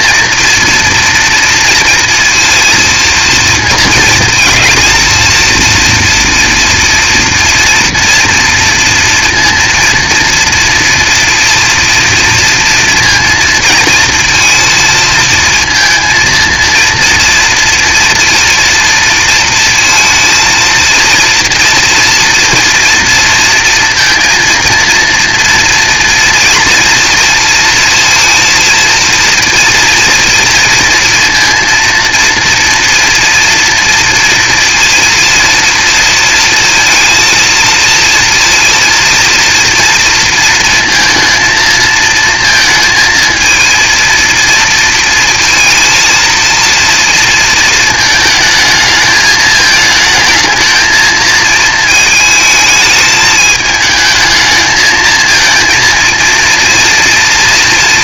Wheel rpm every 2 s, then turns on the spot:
230, 230, 220, 230, 230, 230, 230, 230, 230, 230, 220, 230, 230, 240, 230, 230, 230, 230, 230, 230, 230, 230, 230, 230, 220, 220, 220, 220, 230.
none